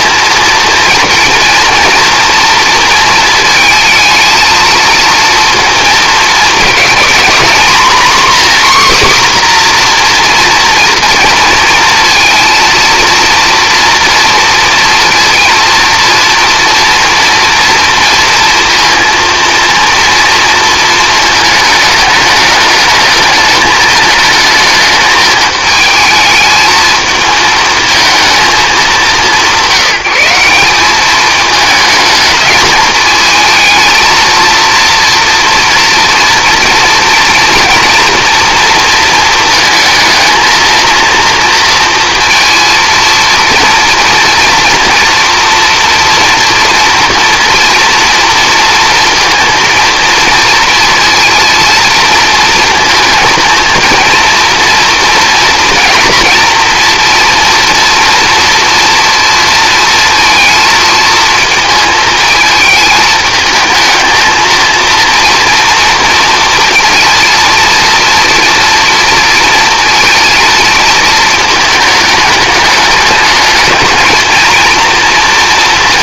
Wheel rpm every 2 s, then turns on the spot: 230, 230, 230, 240, 270, 240, 230, 230, 240, 230, 230, 220, 220, 220, 220, 190, 220, 230, 230, 230, 230, 230, 230, 230, 230, 230, 230, 230, 230, 230, 220, 220, 230, 230, 230, 230, 210, 230.
none